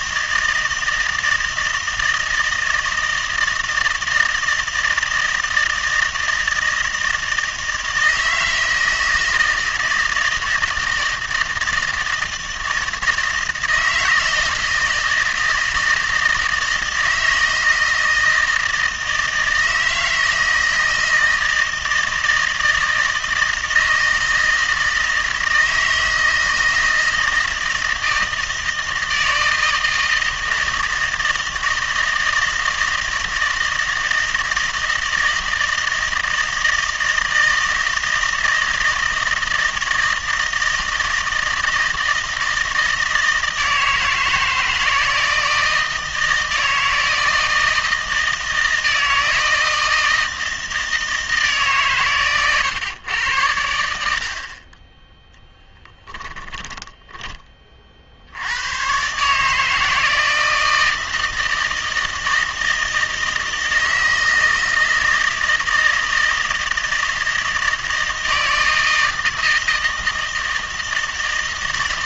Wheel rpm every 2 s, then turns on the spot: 160, 160, 160, 160, 160, 160, 160, 160, 160, 160, 160, 160, 160, 160, 160, 160, 160, 160, 160, 160, 160, 160, 160, 160, 160, 160, 120, 20, 10, 110, 160, 160, 160, 160, 160, 160.
56-58